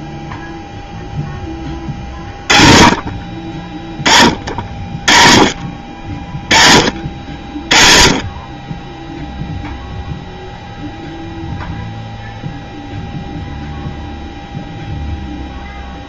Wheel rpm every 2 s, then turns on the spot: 0, 30, 40, 40, 20, 0, 0, 0.
none